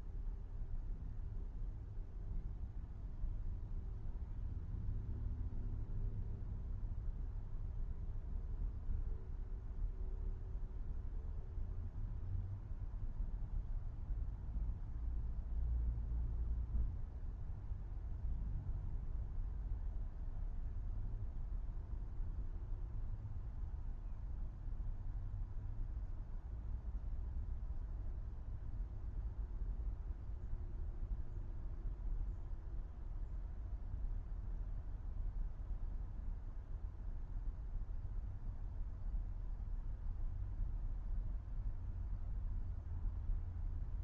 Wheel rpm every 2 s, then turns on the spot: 0, 0, 0, 0, 0, 0, 0, 0, 0, 0, 0, 0, 0, 0, 0, 0, 0, 0, 0, 0, 0, 0.
none